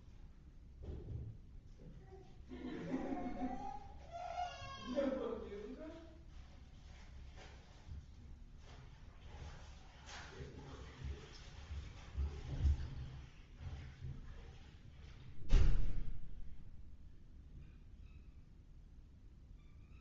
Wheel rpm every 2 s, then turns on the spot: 0, 0, 0, 0, 0, 0, 0, 0, 0, 0.
none